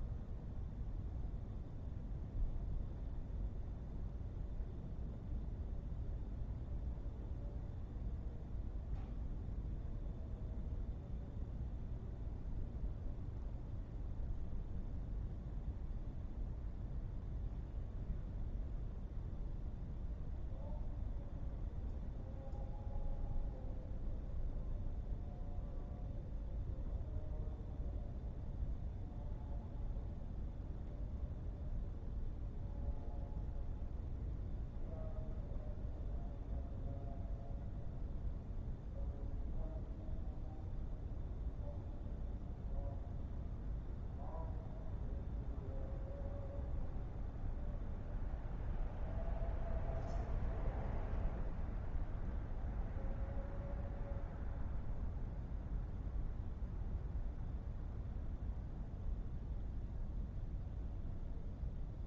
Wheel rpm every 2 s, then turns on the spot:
0, 0, 0, 0, 0, 0, 0, 0, 0, 0, 0, 0, 0, 0, 0, 0, 0, 0, 0, 0, 0, 0, 0, 0, 0, 0, 0, 0, 0, 0, 0.
none